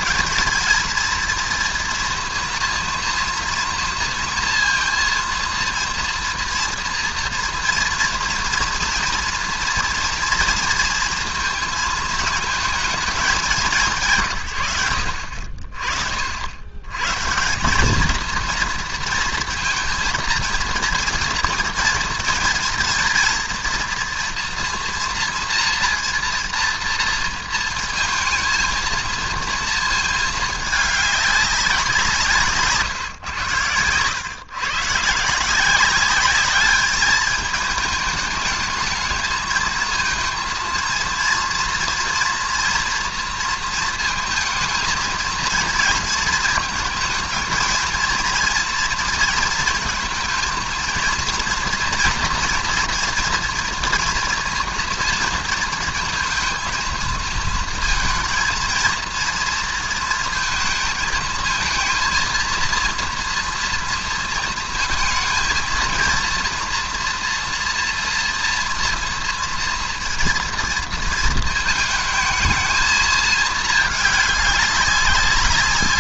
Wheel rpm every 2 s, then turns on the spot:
230, 230, 230, 230, 230, 230, 220, 110, 80, 230, 230, 230, 230, 230, 230, 210, 150, 140, 200, 210, 230, 230, 220, 220, 230, 230, 240, 230, 230, 230, 230, 230, 230, 240, 230, 230, 220, 210.
none